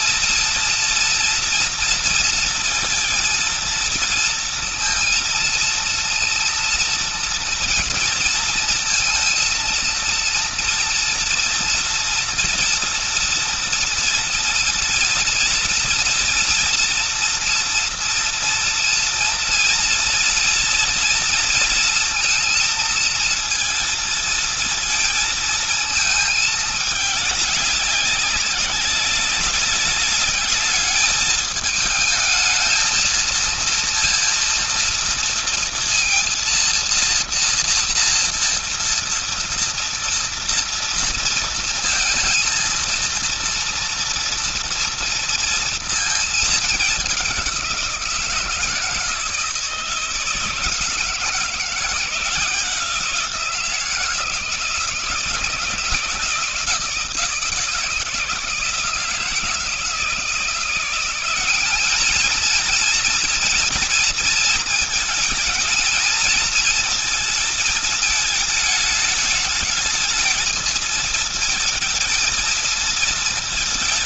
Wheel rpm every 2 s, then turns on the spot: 240, 230, 230, 230, 230, 230, 230, 230, 240, 230, 240, 230, 230, 210, 190, 210, 220, 230, 230, 230, 230, 230, 230, 210, 170, 160, 170, 160, 160, 160, 170, 230, 230, 230, 210, 220, 230.
none